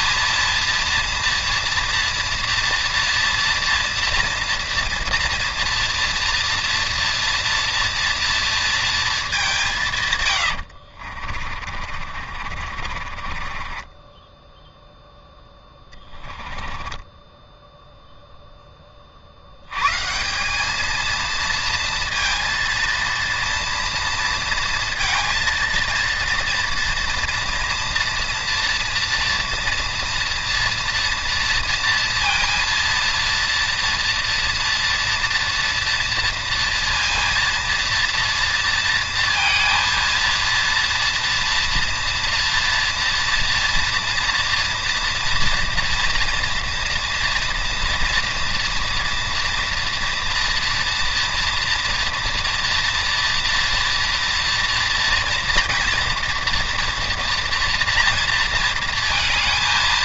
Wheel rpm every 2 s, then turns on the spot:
230, 230, 230, 230, 230, 70, 50, 0, 20, 10, 200, 230, 230, 230, 230, 230, 230, 230, 230, 230, 230, 240, 230, 240, 230, 230, 230, 230, 230, 230.
10-14 16-18